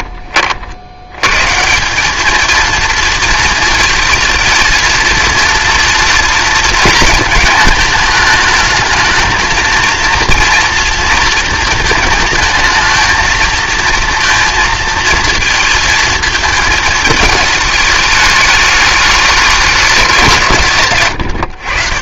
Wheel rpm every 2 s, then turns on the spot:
70, 230, 230, 220, 220, 230, 220, 230, 220, 210, 130.
none